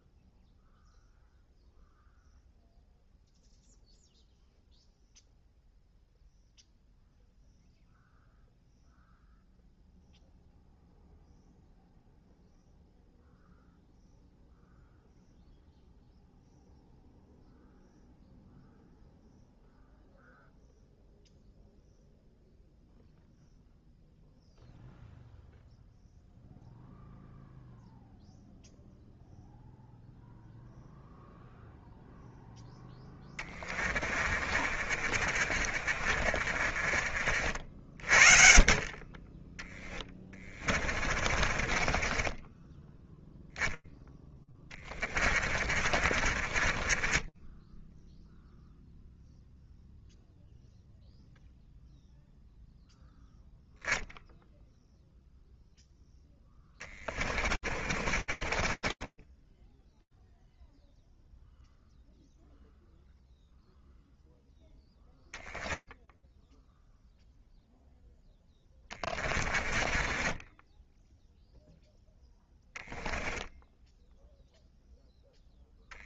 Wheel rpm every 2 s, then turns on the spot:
0, 0, 0, 0, 0, 0, 0, 0, 0, 0, 0, 0, 0, 0, 0, 0, 10, 40, 50, 40, 20, 20, 20, 30, 0, 0, 0, 0, 30, 20, 0, 0, 10, 0, 20, 10, 10, 0.
34-38 40-48 56-60 68-72